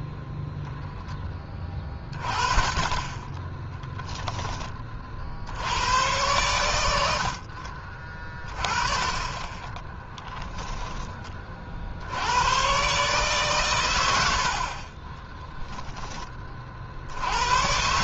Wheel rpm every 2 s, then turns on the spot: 0, 20, 30, 90, 30, 10, 130, 30, 50.
14-16